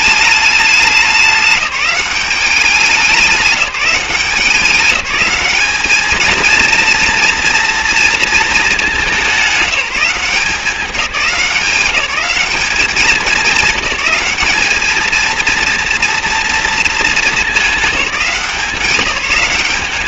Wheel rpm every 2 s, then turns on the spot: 200, 190, 190, 230, 230, 190, 190, 210, 230, 190.
none